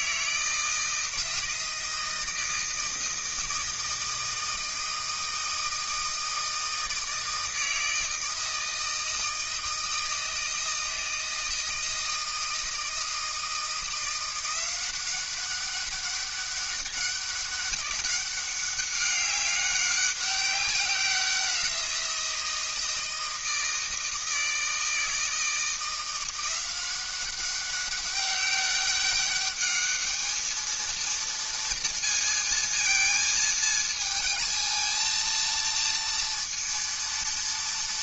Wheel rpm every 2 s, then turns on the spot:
160, 160, 160, 160, 160, 160, 160, 180, 200, 200, 190, 160, 160, 180, 200, 220, 230, 220, 230.
none